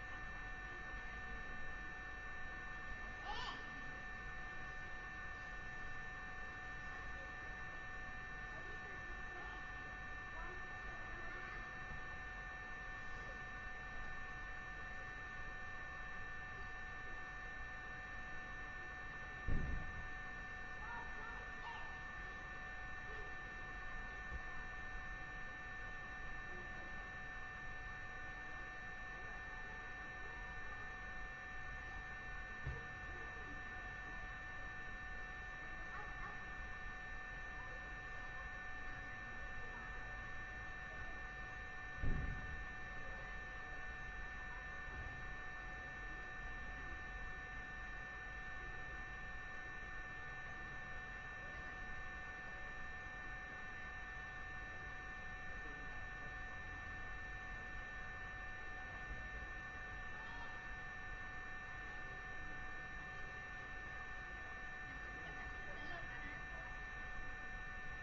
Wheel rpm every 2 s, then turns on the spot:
0, 0, 0, 0, 0, 0, 0, 0, 0, 0, 0, 0, 0, 0, 0, 0, 0, 0, 0, 0, 0, 0, 0, 0, 0, 0, 0, 0, 0, 0, 0, 0, 0, 0.
none